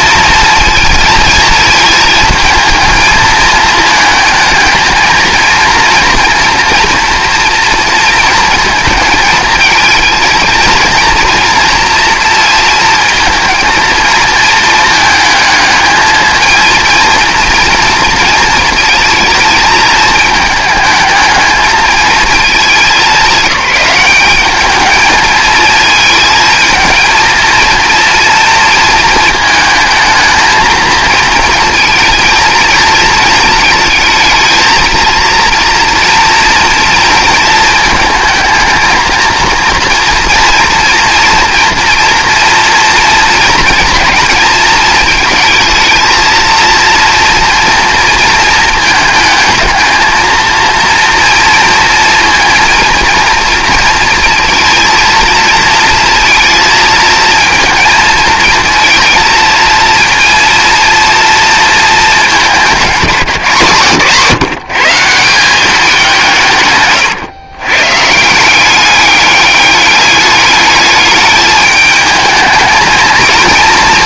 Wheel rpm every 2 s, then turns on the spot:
220, 220, 220, 230, 230, 230, 220, 220, 230, 230, 220, 210, 210, 220, 230, 220, 230, 220, 230, 220, 240, 240, 230, 230, 220, 230, 230, 230, 220, 230, 230, 210, 160, 140, 190, 210, 220.
66-68